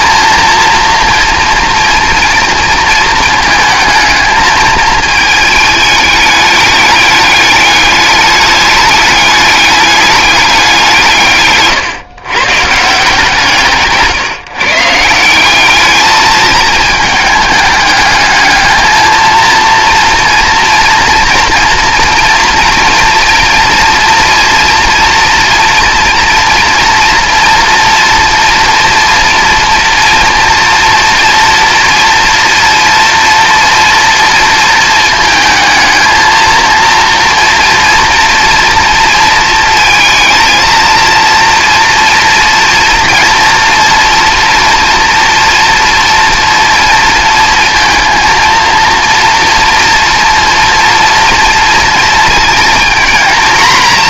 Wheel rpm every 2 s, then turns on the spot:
230, 230, 220, 220, 210, 190, 140, 150, 220, 220, 230, 240, 230, 230, 240, 230, 230, 230, 230, 230, 230, 230, 230, 230, 230, 230, 230.
none